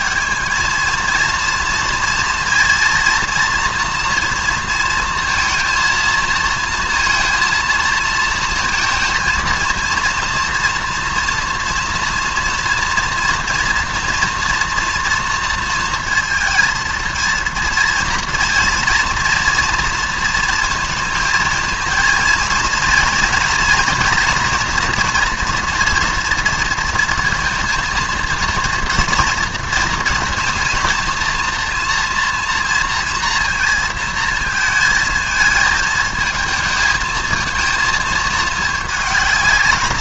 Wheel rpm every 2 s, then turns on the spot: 220, 240, 230, 230, 230, 230, 230, 230, 230, 230, 230, 240, 230, 230, 240, 230, 230, 220, 220, 210.
none